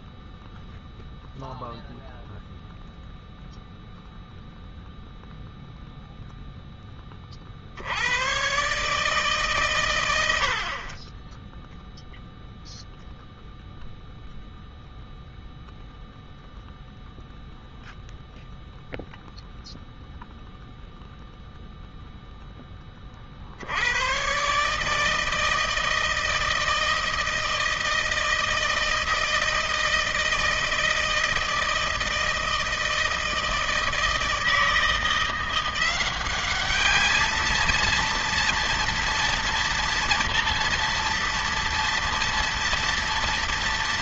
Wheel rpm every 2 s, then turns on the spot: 0, 0, 0, 0, 120, 60, 0, 0, 0, 0, 0, 10, 130, 160, 160, 160, 160, 160, 200, 230, 240, 230.
none